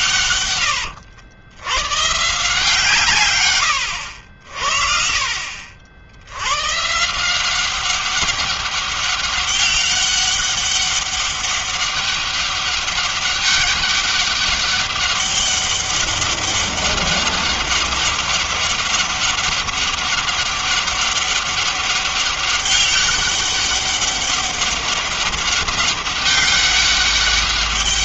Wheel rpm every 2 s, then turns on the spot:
110, 140, 70, 100, 190, 200, 200, 200, 200, 200, 200, 200, 200, 200.
none